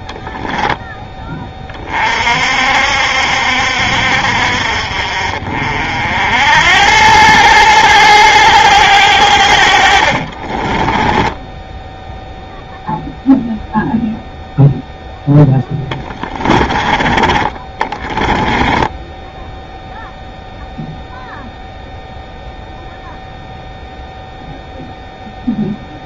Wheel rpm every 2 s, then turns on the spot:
10, 60, 50, 90, 100, 30, 0, 0, 20, 20, 0, 0, 0.
10-12 18-20